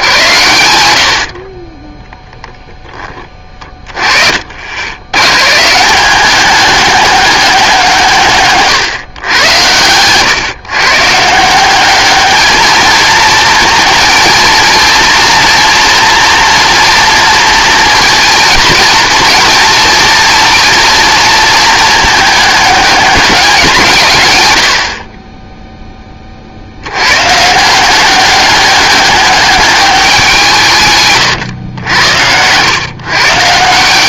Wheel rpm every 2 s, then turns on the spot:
90, 10, 60, 200, 140, 130, 220, 230, 230, 220, 230, 210, 100, 70, 200, 160, 120.
8-10